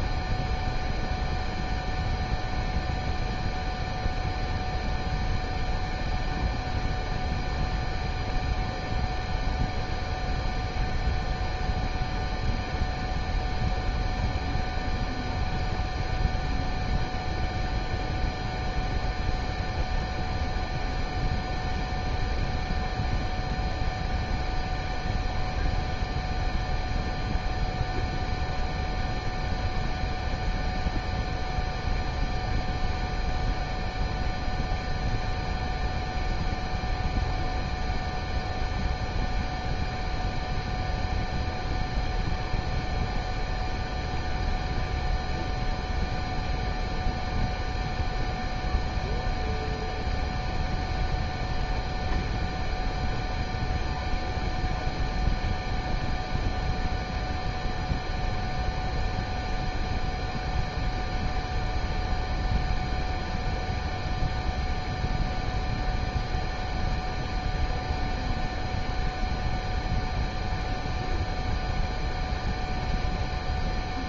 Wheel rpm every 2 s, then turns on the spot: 0, 0, 0, 0, 0, 0, 0, 0, 0, 0, 0, 0, 0, 0, 0, 0, 0, 0, 0, 0, 0, 0, 0, 0, 0, 0, 0, 0, 0, 0, 0, 0, 0, 0, 0, 0, 0.
none